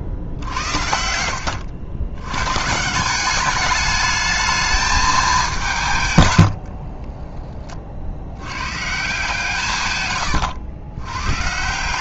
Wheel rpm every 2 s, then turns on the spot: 80, 150, 220, 80, 130, 100.
6-8